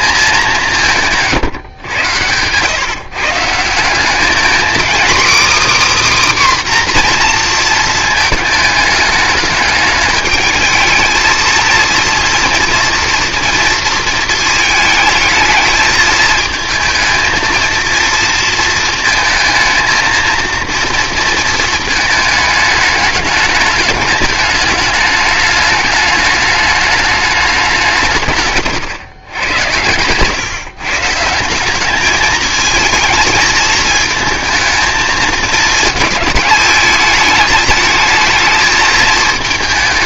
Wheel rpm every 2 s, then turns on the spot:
190, 130, 250, 270, 210, 210, 240, 220, 220, 230, 230, 210, 210, 210, 130, 140, 220, 220, 220, 220.
none